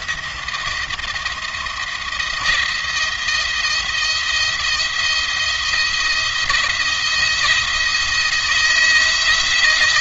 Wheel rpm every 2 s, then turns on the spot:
170, 170, 170, 170, 170.
none